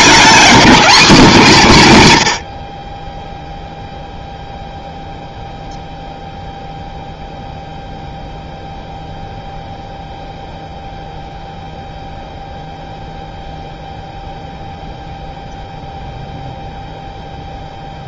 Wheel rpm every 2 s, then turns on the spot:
240, 60, 0, 0, 0, 0, 0, 0, 0.
none